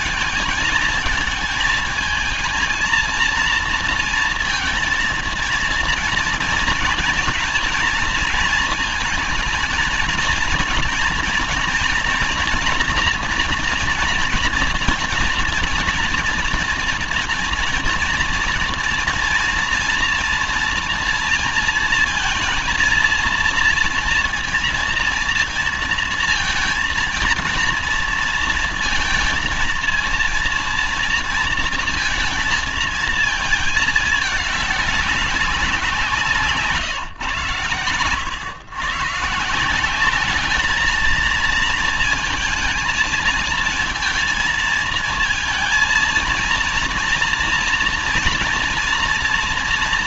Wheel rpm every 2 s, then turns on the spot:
220, 220, 230, 230, 230, 220, 230, 230, 240, 230, 230, 230, 230, 230, 230, 230, 230, 210, 160, 120, 210, 220, 220, 230, 230.
none